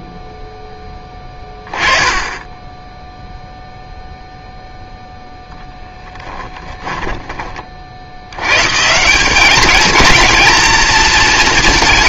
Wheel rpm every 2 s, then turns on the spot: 10, 10, 0, 10, 150, 230.
6-8